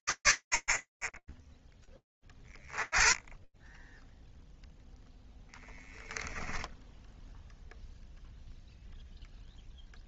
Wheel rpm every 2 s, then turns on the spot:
50, 30, 0, 0, 0.
none